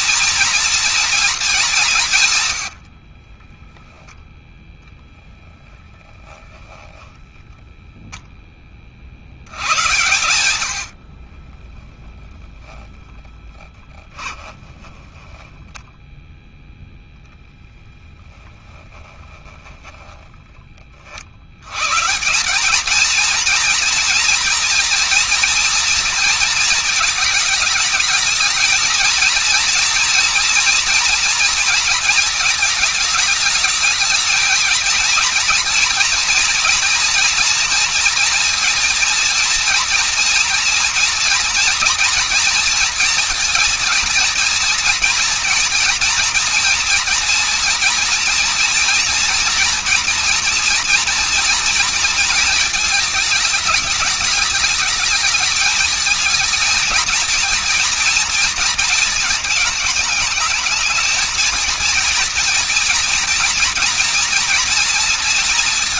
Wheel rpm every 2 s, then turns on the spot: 240, 110, 10, 10, 10, 100, 0, 20, 0, 10, 10, 180, 230, 220, 220, 230, 220, 220, 230, 230, 240, 240, 230, 240, 230, 230, 220, 220, 220, 230, 220, 230, 240.
6-8 14-16